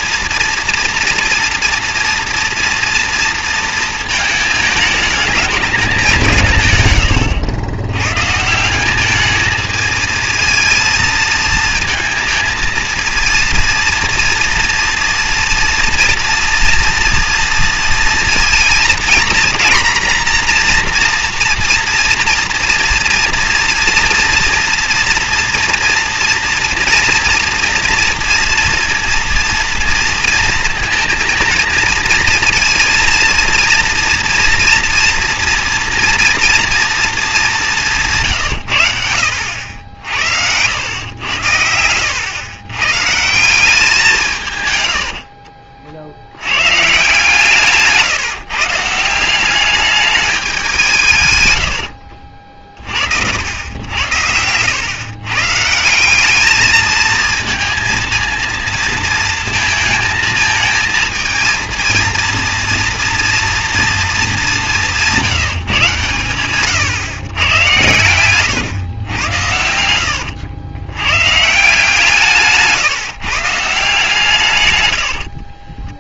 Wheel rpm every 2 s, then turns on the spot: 230, 230, 220, 160, 150, 230, 230, 230, 230, 230, 240, 240, 230, 230, 230, 230, 230, 230, 230, 140, 80, 100, 150, 90, 160, 200, 50, 90, 210, 220, 220, 230, 210, 130, 120, 110, 150, 130.
none